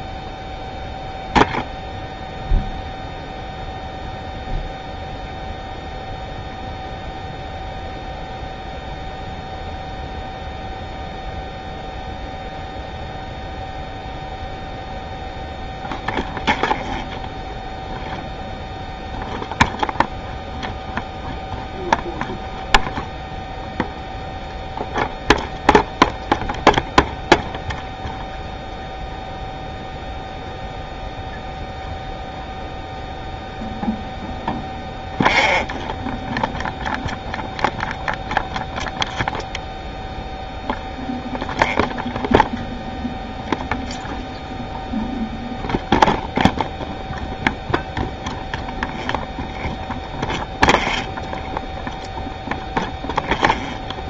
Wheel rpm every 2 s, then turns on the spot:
0, 0, 0, 0, 0, 0, 0, 0, 0, 0, 0, 0, 0, 0, 0, 0, 0, 0, 0, 0, 0, 0, 0, 0, 0, 0, 0.
none